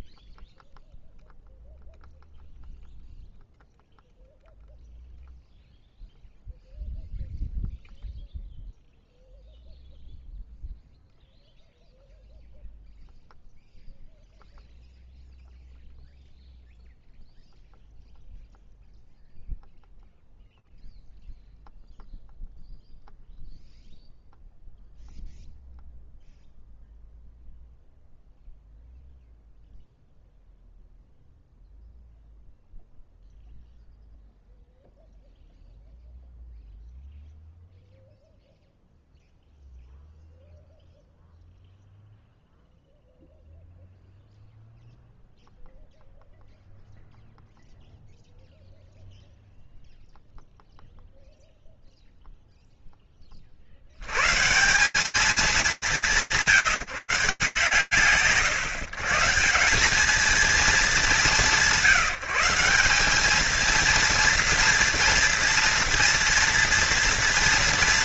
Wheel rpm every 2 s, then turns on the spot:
0, 0, 0, 0, 0, 0, 0, 0, 0, 0, 0, 0, 0, 0, 0, 0, 0, 0, 0, 0, 0, 0, 0, 0, 0, 0, 0, 140, 170, 130, 210, 180, 230, 230.
none